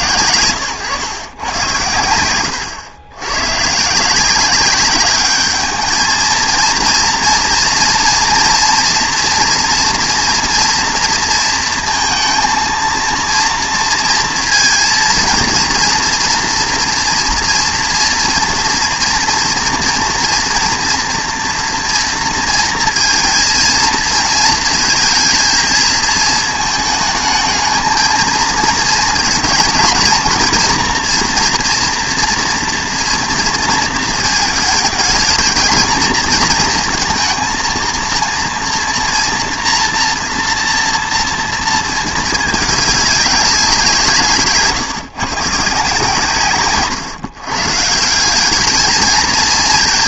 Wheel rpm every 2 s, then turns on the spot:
120, 110, 200, 230, 240, 230, 230, 230, 230, 230, 230, 230, 220, 220, 220, 230, 230, 220, 230, 230, 230, 200, 150, 130, 220.
none